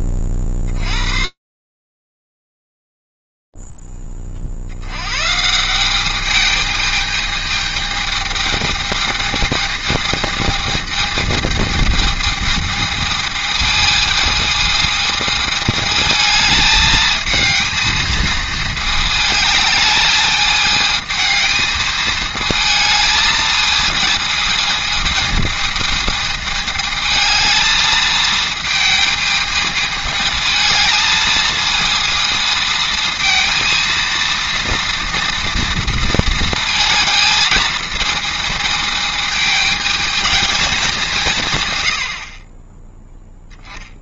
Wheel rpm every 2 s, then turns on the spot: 50, 0, 90, 210, 220, 220, 220, 210, 220, 220, 220, 220, 220, 220, 220, 220, 230, 230, 220, 220, 190, 10.
none